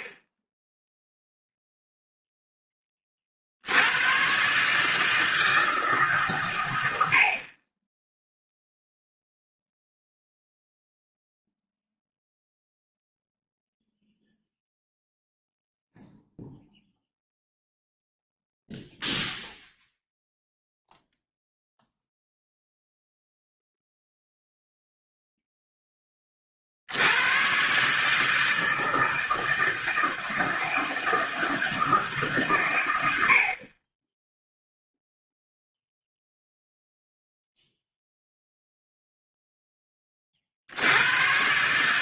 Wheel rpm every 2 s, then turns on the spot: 10, 10, 130, 110, 0, 0, 0, 0, 0, 0, 0, 0, 0, 50, 160, 160, 120, 0, 0, 0, 60.
none